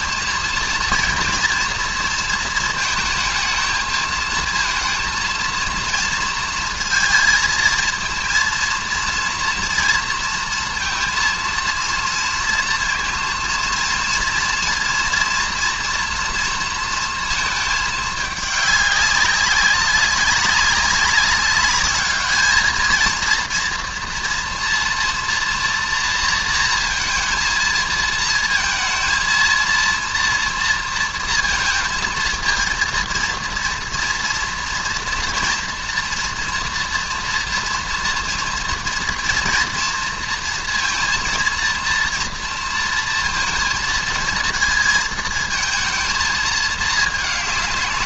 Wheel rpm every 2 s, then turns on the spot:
230, 230, 230, 230, 230, 230, 230, 230, 230, 200, 200, 220, 230, 230, 230, 230, 230, 230, 230, 230, 230, 230, 220, 220.
none